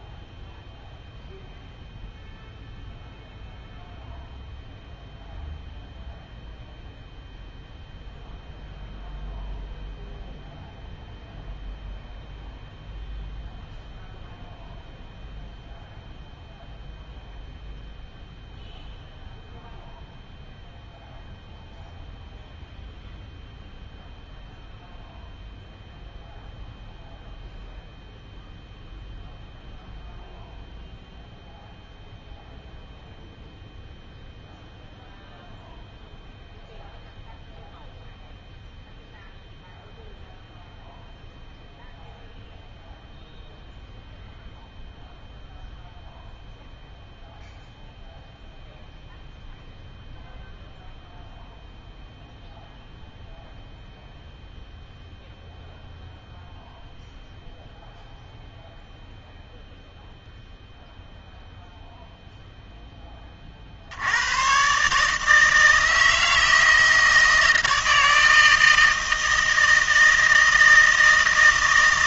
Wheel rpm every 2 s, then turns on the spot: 0, 0, 0, 0, 0, 0, 0, 0, 0, 0, 0, 0, 0, 0, 0, 0, 0, 0, 0, 0, 0, 0, 0, 0, 0, 0, 0, 0, 0, 0, 0, 10, 140, 160, 160, 160.
none